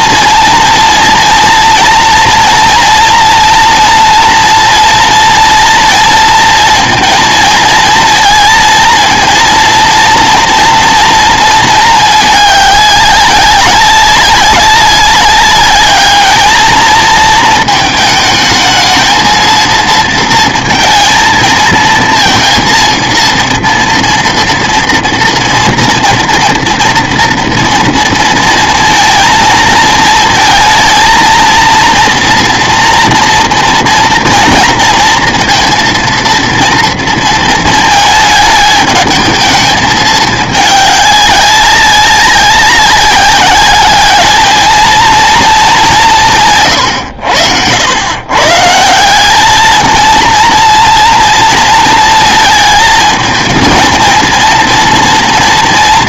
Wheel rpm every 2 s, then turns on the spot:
240, 230, 230, 230, 230, 230, 210, 190, 220, 220, 230, 230, 230, 230, 230, 230, 230, 230, 230, 220, 210, 190, 220, 120, 150, 230, 220, 230.
none